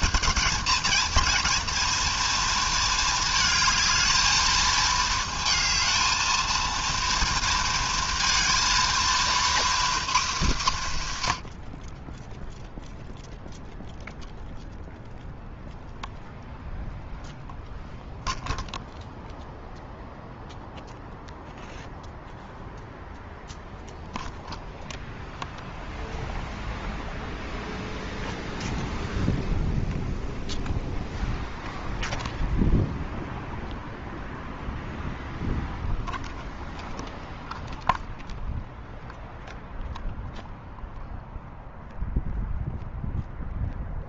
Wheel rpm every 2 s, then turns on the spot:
220, 230, 220, 230, 230, 190, 0, 0, 0, 0, 0, 0, 0, 0, 0, 0, 0, 0, 0, 0, 0, 0.
none